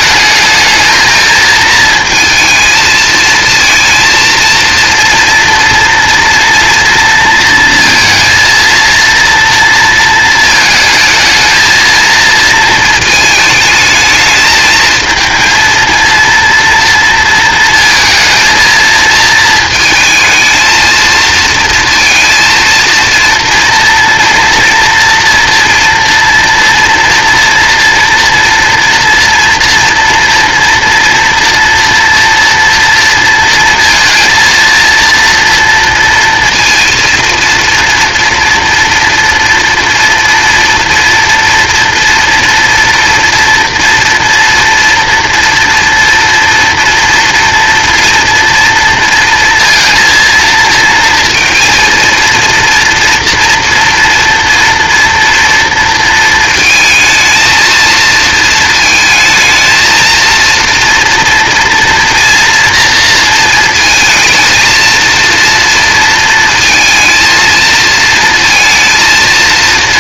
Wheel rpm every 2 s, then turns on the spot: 220, 220, 230, 230, 230, 220, 230, 220, 230, 220, 230, 230, 230, 240, 230, 230, 230, 230, 230, 230, 240, 230, 230, 230, 230, 230, 230, 230, 230, 230, 230, 230, 230, 220, 230.
none